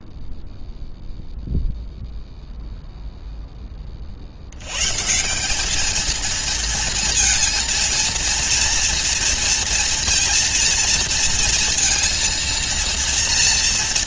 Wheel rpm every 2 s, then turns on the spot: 0, 0, 110, 230, 230, 230, 230.
none